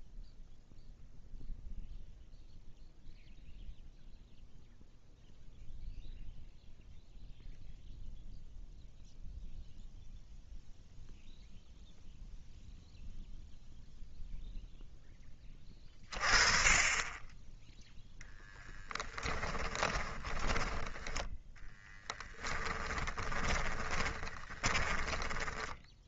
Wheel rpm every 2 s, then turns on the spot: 0, 0, 0, 0, 0, 0, 0, 10, 20, 10, 20, 10, 20.
18-26